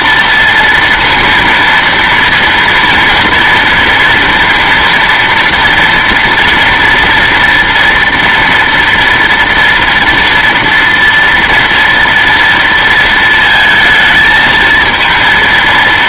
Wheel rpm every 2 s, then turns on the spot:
230, 230, 230, 230, 230, 230, 230, 220.
none